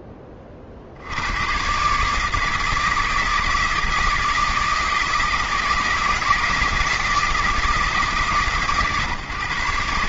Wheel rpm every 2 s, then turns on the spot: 80, 160, 160, 160, 130.
none